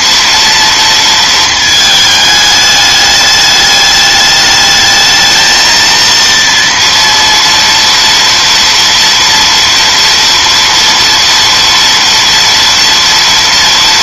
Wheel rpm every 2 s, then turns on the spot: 230, 210, 210, 230, 230, 230, 230.
none